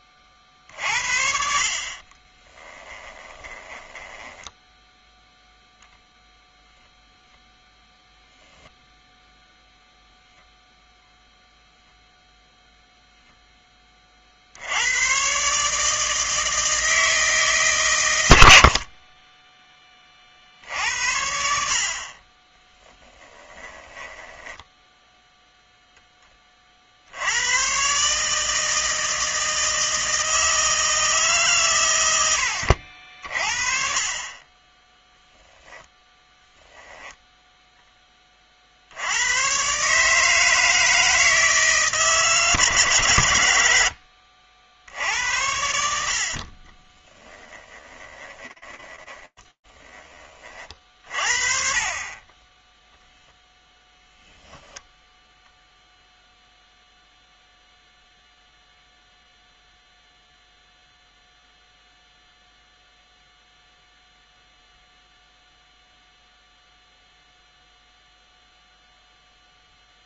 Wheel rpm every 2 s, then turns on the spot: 40, 20, 10, 0, 10, 0, 0, 70, 160, 70, 60, 20, 0, 30, 160, 160, 70, 20, 0, 40, 160, 140, 70, 40, 20, 30, 20, 0, 0, 0, 0, 0, 0, 0, 0.
2-6 22-24 46-50